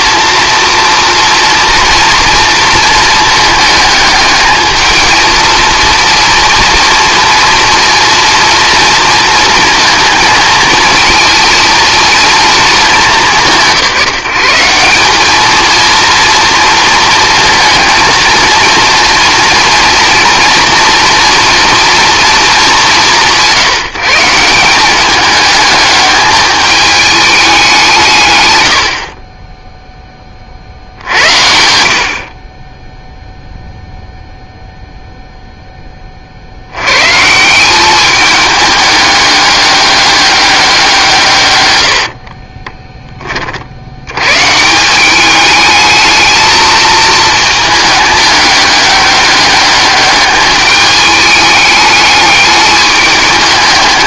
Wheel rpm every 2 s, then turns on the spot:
230, 230, 220, 230, 230, 230, 220, 170, 230, 230, 230, 210, 180, 210, 100, 60, 30, 0, 80, 210, 190, 20, 150, 220, 210, 210, 210.
42-44